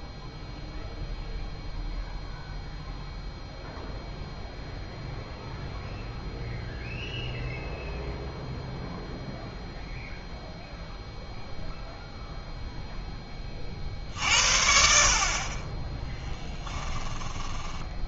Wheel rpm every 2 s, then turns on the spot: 0, 0, 0, 0, 0, 0, 0, 60, 10.
16-18